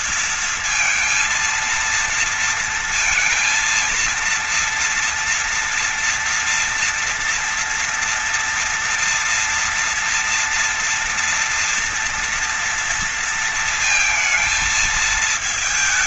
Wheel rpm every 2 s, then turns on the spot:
230, 230, 230, 230, 230, 240, 230, 230.
none